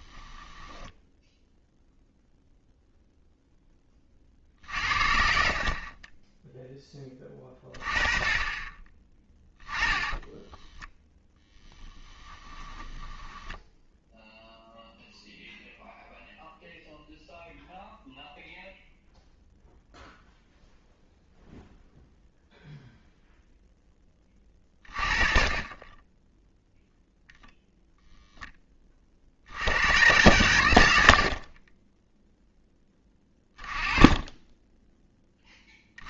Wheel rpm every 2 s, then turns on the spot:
10, 0, 50, 10, 20, 10, 10, 0, 0, 0, 0, 0, 30, 0, 20, 100, 10, 10.
0-2 4-6 12-14